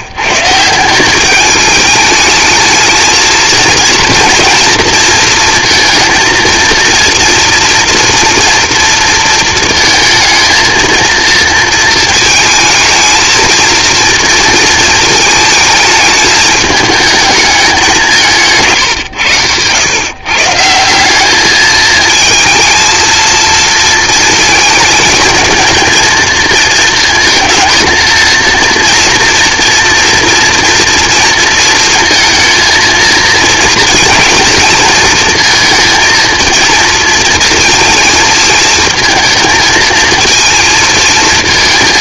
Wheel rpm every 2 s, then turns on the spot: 160, 220, 230, 230, 230, 220, 220, 220, 220, 150, 160, 220, 220, 230, 230, 230, 230, 230, 230, 220, 230.
none